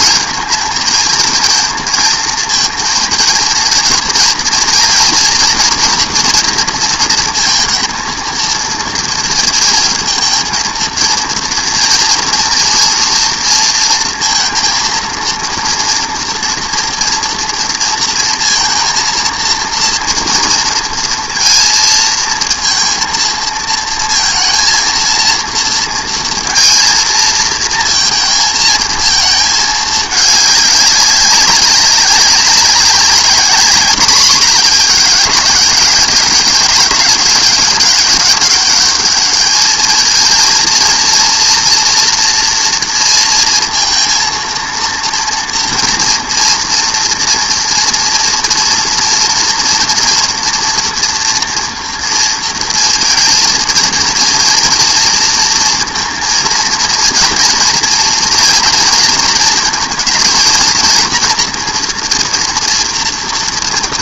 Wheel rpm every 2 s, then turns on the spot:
220, 230, 240, 240, 230, 230, 230, 230, 230, 230, 230, 230, 230, 230, 220, 210, 200, 210, 200, 200, 230, 230, 230, 230, 230, 230, 230, 230, 230, 220, 230, 230.
none